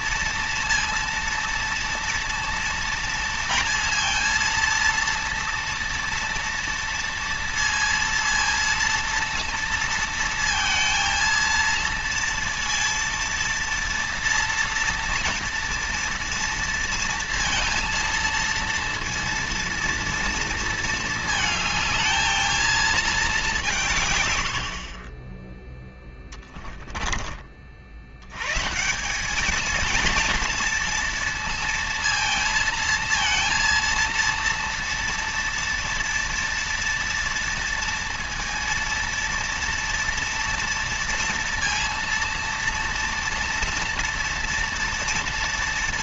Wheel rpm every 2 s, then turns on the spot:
230, 230, 230, 230, 230, 230, 230, 230, 230, 230, 220, 220, 50, 20, 170, 230, 230, 230, 230, 230, 230, 230, 230.
none